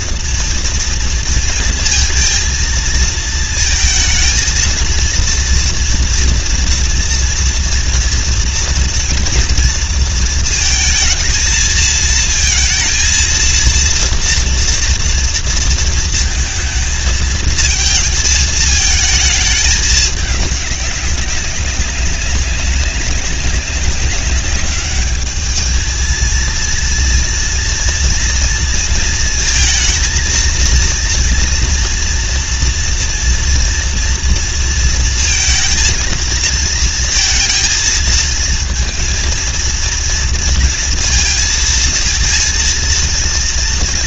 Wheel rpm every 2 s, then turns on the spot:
230, 230, 230, 230, 230, 230, 230, 230, 220, 220, 200, 190, 200, 230, 230, 230, 230, 230, 230, 230, 230, 230.
none